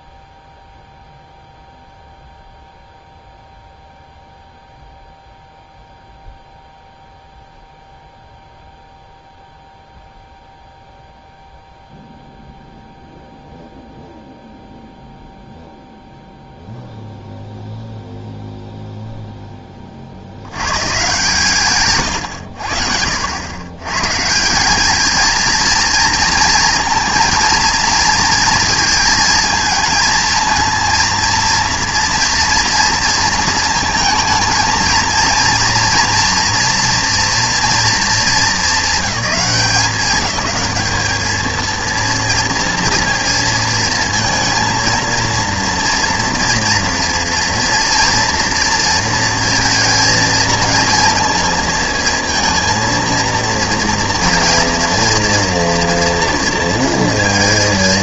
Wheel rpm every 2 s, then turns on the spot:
0, 0, 0, 0, 0, 0, 0, 0, 0, 0, 120, 70, 200, 230, 220, 230, 230, 230, 240, 190, 200, 230, 220, 230, 230, 230, 230, 230, 230.
none